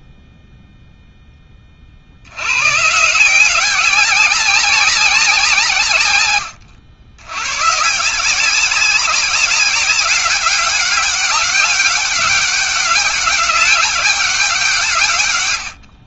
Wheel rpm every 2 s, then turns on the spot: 10, 150, 180, 100, 190, 200, 190, 150.
none